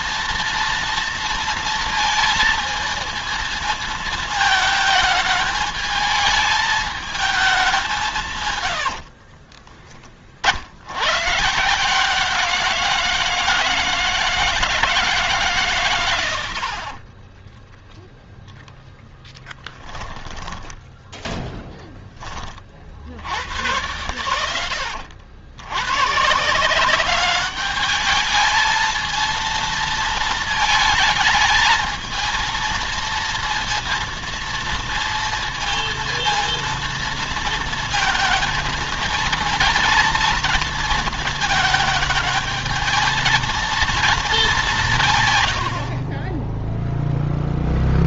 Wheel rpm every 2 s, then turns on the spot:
230, 220, 220, 220, 100, 70, 170, 160, 60, 10, 10, 50, 80, 180, 220, 230, 230, 230, 230, 230, 230, 220, 190, 10.
8-10 16-22 46-48